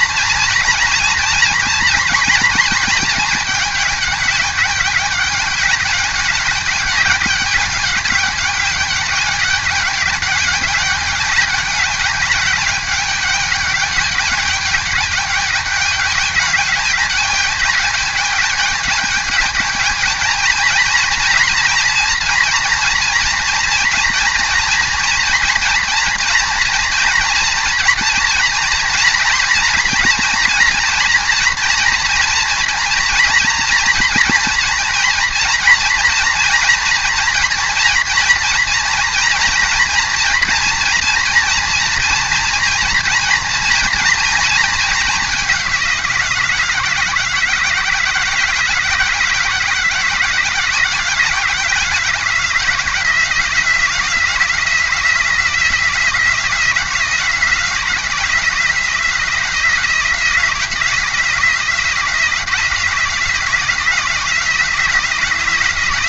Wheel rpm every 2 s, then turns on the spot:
240, 230, 210, 200, 200, 200, 200, 210, 200, 210, 220, 230, 230, 230, 240, 230, 230, 230, 240, 230, 240, 240, 230, 180, 170, 170, 170, 180, 170, 170, 170, 170, 180.
none